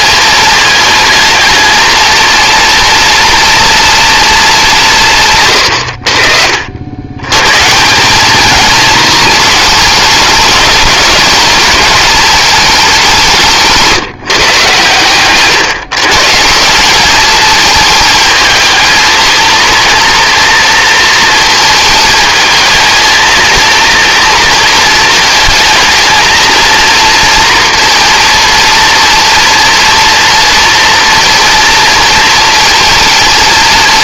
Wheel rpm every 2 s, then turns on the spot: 210, 230, 180, 80, 220, 210, 200, 140, 180, 220, 230, 220, 220, 230, 230, 230, 220.
none